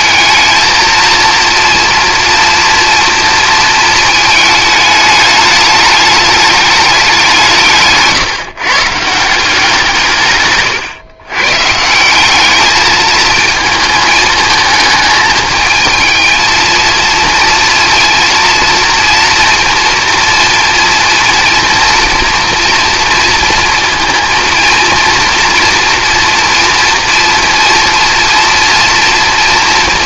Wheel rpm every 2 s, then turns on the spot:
230, 230, 210, 200, 150, 130, 220, 220, 230, 230, 230, 230, 230, 230, 230.
none